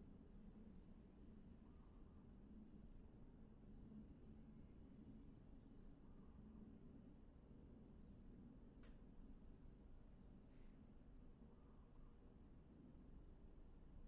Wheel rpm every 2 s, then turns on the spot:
0, 0, 0, 0, 0, 0, 0.
none